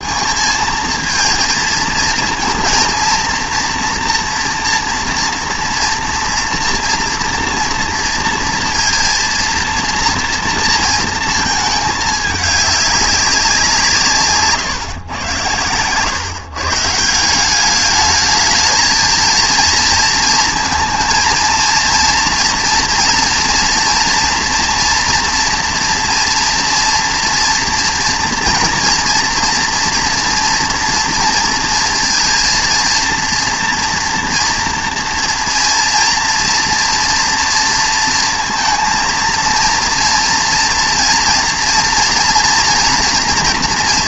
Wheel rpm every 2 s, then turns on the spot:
220, 230, 230, 230, 230, 230, 200, 140, 160, 220, 220, 230, 240, 230, 230, 230, 230, 230, 230, 230, 230, 240.
none